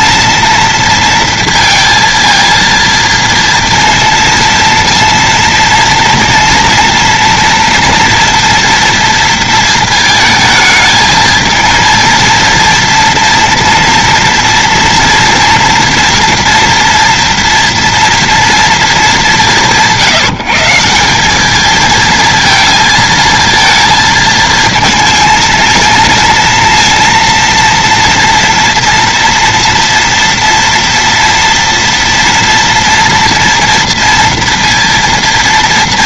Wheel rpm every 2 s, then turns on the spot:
230, 230, 230, 230, 230, 220, 230, 230, 230, 230, 170, 230, 220, 230, 240, 230, 240, 230.
none